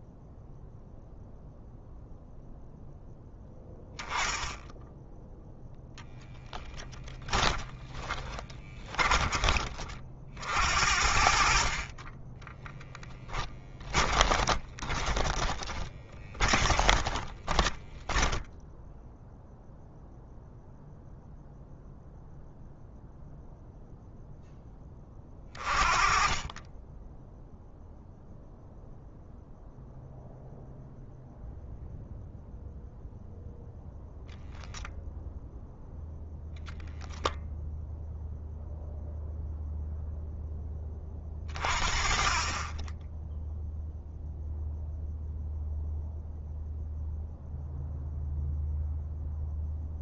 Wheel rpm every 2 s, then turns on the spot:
0, 0, 0, 0, 20, 60, 10, 30, 20, 10, 0, 0, 10, 10, 0, 0, 0, 0, 10, 0, 20, 20, 0, 0, 0.
8-10 12-20